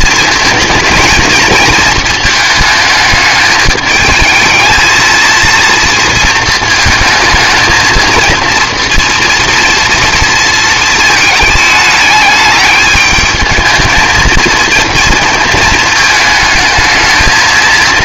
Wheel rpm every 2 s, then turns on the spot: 230, 220, 220, 220, 230, 230, 210, 230, 220.
none